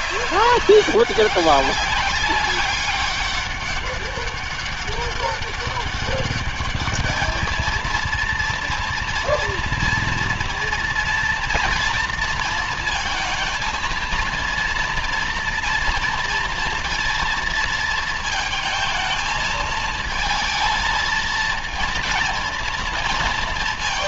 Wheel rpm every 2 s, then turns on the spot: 200, 200, 200, 210, 240, 230, 220, 230, 230, 220, 230, 230.
none